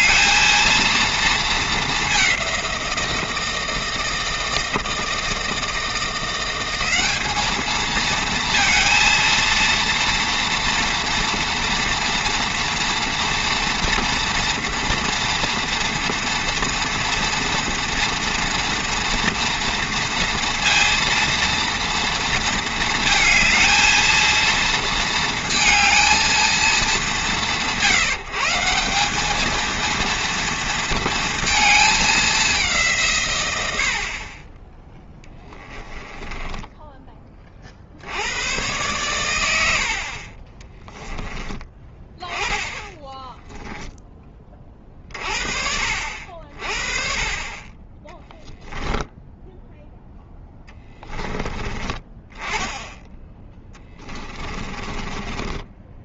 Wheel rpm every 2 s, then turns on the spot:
230, 180, 160, 190, 230, 240, 230, 230, 230, 230, 230, 220, 230, 190, 180, 230, 180, 10, 10, 110, 10, 20, 40, 40, 10, 10, 10, 20.
34-38 40-42 50-52 54-56